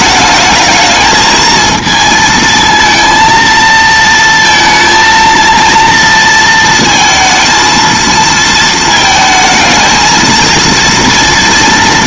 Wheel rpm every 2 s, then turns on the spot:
220, 230, 230, 230, 220, 230.
none